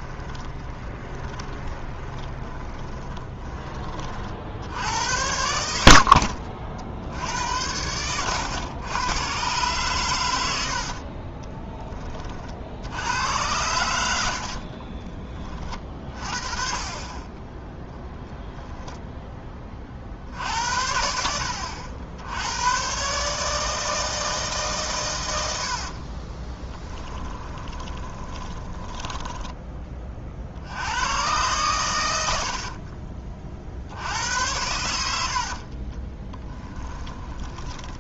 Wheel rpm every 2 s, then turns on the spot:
20, 20, 70, 60, 110, 70, 70, 40, 30, 0, 70, 100, 140, 20, 10, 80, 50, 90, 10.
0-4 10-12 14-16 26-30 32-34 36-38